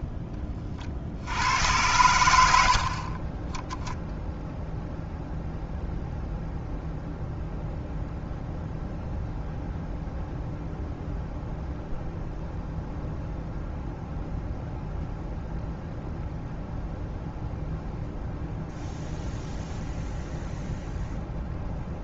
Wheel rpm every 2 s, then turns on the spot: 40, 60, 0, 0, 0, 0, 0, 0, 0, 0, 0.
none